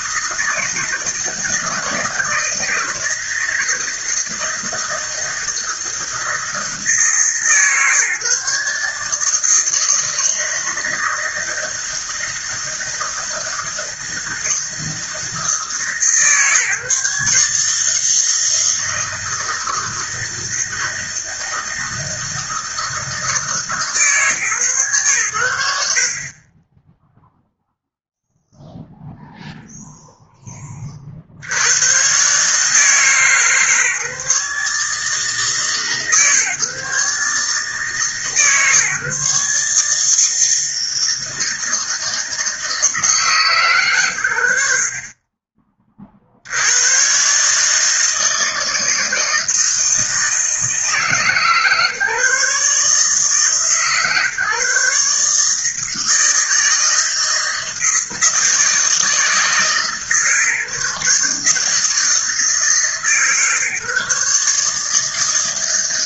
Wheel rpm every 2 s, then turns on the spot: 160, 160, 160, 160, 150, 160, 160, 160, 150, 160, 160, 160, 110, 10, 0, 30, 150, 150, 140, 140, 160, 160, 50, 110, 160, 150, 140, 140, 160, 160, 150, 150, 160.
none